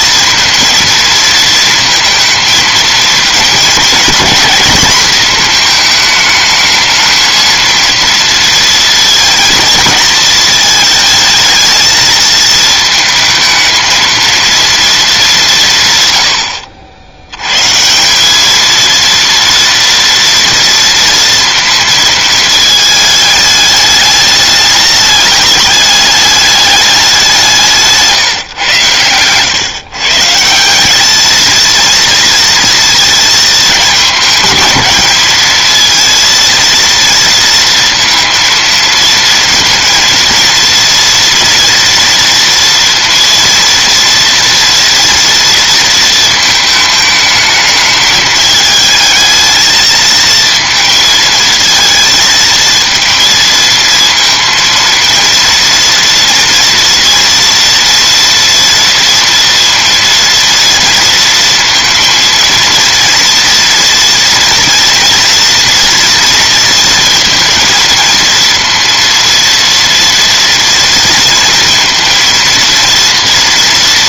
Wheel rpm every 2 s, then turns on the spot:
230, 220, 220, 220, 230, 220, 220, 230, 70, 220, 230, 220, 210, 210, 120, 180, 230, 220, 230, 230, 230, 230, 230, 220, 220, 220, 230, 230, 230, 230, 230, 230, 240, 230, 230, 230, 230.
none